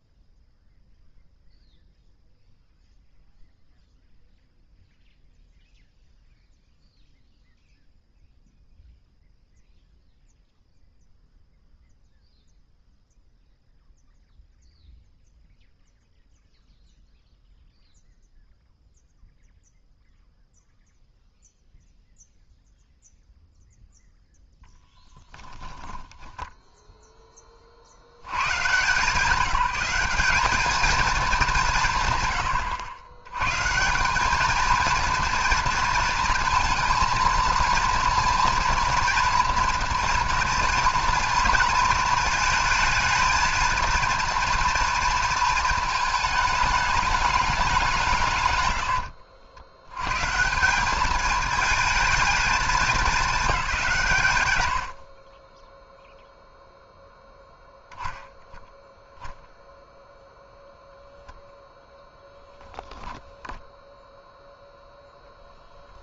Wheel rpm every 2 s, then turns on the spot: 0, 0, 0, 0, 0, 0, 0, 0, 0, 0, 0, 0, 0, 10, 140, 220, 100, 220, 230, 230, 230, 220, 230, 210, 130, 180, 220, 110, 0, 0, 0, 10, 0.
26-28